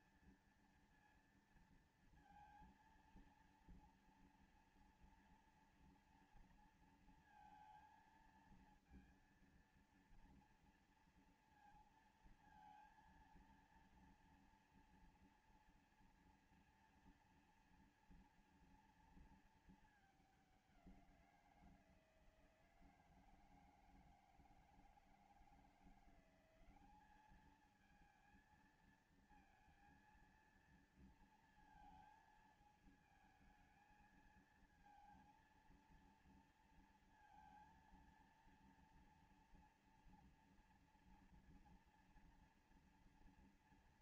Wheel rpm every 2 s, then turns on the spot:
230, 230, 230, 230, 230, 230, 230, 230, 230, 230, 200, 160, 160, 190, 230, 230, 220, 230, 230, 230, 230, 230.
none